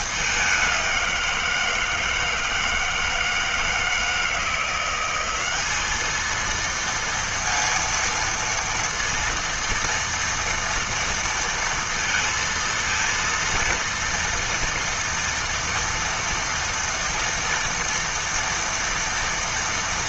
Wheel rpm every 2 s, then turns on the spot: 190, 160, 180, 230, 230, 230, 230, 230, 230, 230.
none